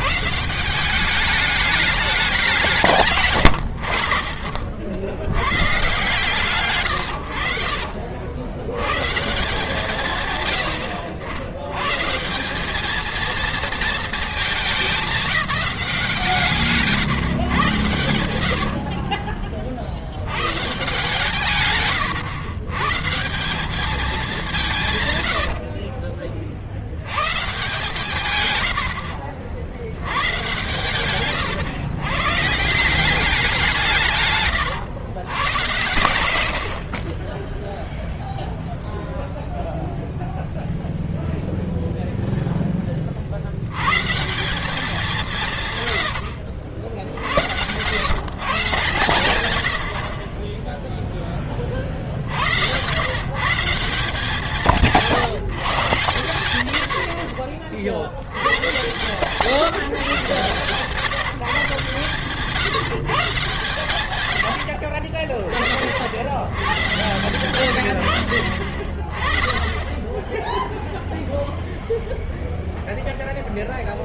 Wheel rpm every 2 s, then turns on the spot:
170, 190, 70, 130, 70, 110, 170, 210, 140, 70, 90, 120, 190, 40, 110, 100, 160, 140, 80, 0, 0, 10, 180, 80, 140, 30, 60, 180, 100, 90, 130, 150, 80, 80, 70, 10, 0.
4-6 18-20